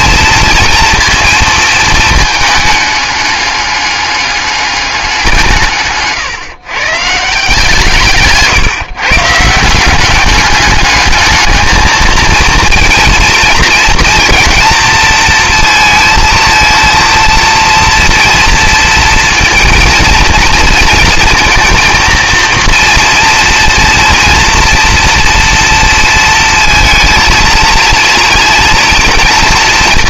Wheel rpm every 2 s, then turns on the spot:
230, 210, 200, 130, 150, 210, 230, 230, 230, 230, 230, 230, 230, 220, 230.
none